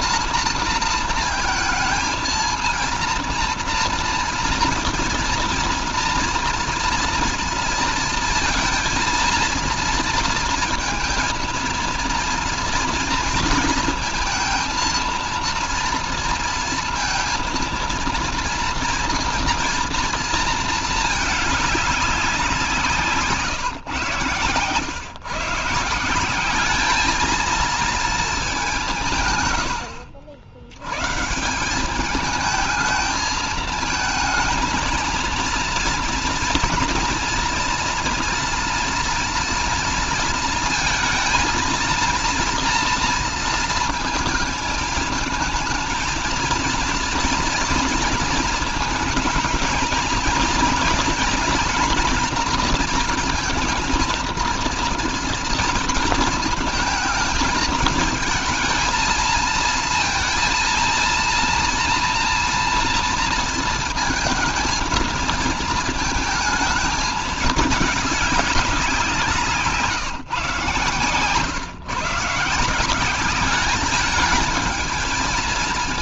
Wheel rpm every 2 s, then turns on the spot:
230, 230, 230, 230, 230, 230, 230, 230, 230, 230, 220, 170, 120, 200, 190, 100, 220, 220, 230, 240, 230, 230, 220, 230, 230, 230, 230, 230, 220, 220, 230, 230, 220, 220, 190, 140, 180, 220.
none